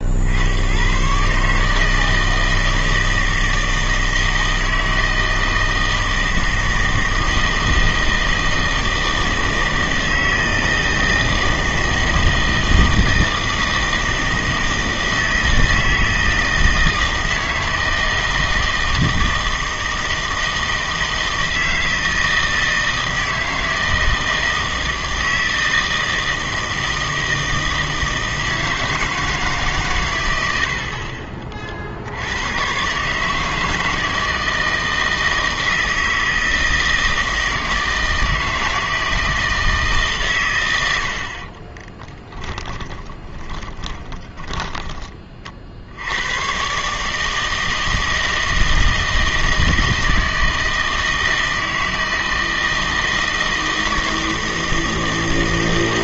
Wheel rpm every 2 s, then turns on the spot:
110, 160, 160, 160, 160, 160, 160, 160, 160, 160, 160, 160, 160, 160, 160, 60, 120, 160, 160, 160, 100, 20, 10, 130, 160, 160, 160, 160.
42-46